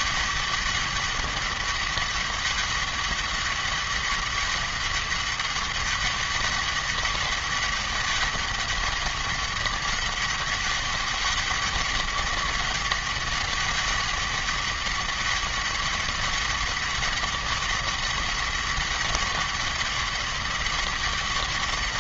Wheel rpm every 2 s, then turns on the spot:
200, 200, 200, 200, 200, 200, 200, 200, 200, 200, 200.
none